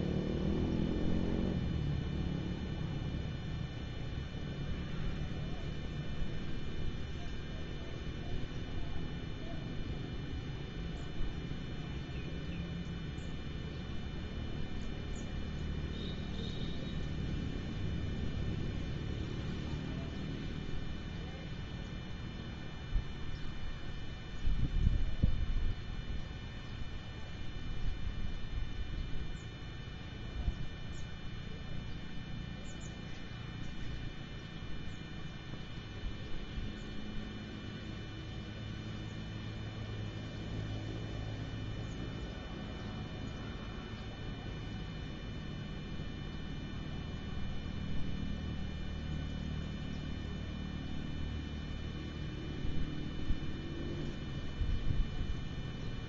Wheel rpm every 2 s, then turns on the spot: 0, 0, 0, 0, 0, 0, 0, 0, 0, 0, 0, 0, 0, 0, 0, 0, 0, 0, 0, 0, 0, 0, 0, 0, 0, 0, 0, 0.
none